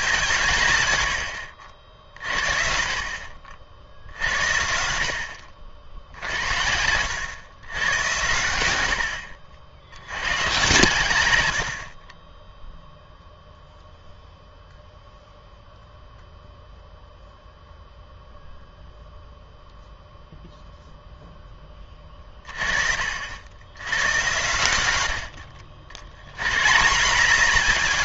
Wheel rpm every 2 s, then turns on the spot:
140, 50, 70, 80, 90, 110, 0, 0, 0, 0, 0, 30, 100, 140.
6-8